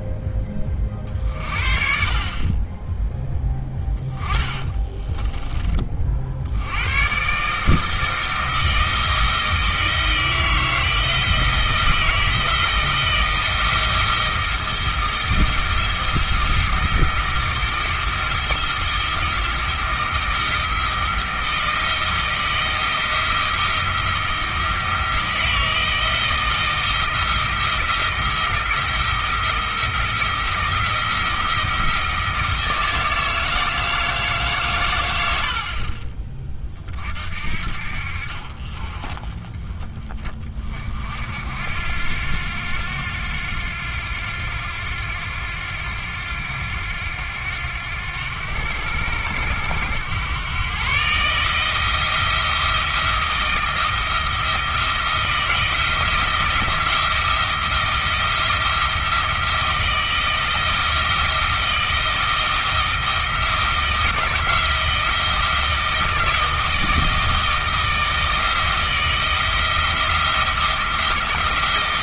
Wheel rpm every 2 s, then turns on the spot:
30, 20, 20, 100, 160, 160, 170, 170, 170, 170, 170, 170, 170, 170, 170, 170, 160, 120, 40, 40, 40, 90, 90, 90, 90, 120, 160, 170, 170, 170, 170, 170, 170, 160, 160, 170.
4-6